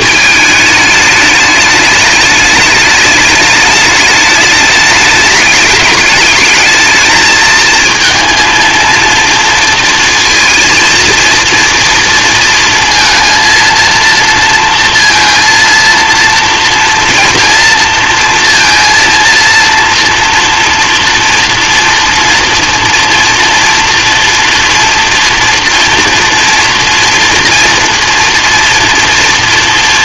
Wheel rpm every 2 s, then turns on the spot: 220, 210, 210, 210, 230, 230, 230, 230, 230, 230, 230, 230, 240, 230, 230.
none